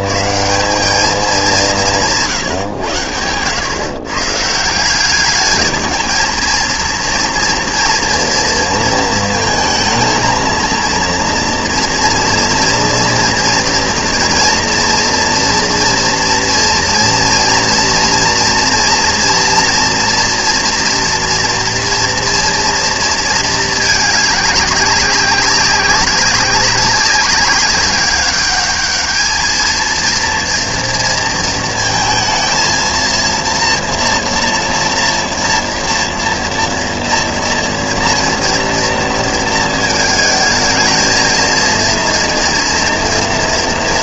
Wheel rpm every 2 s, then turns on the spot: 130, 130, 160, 230, 230, 230, 230, 230, 230, 230, 230, 230, 210, 190, 200, 230, 230, 240, 240, 230, 220, 230.
none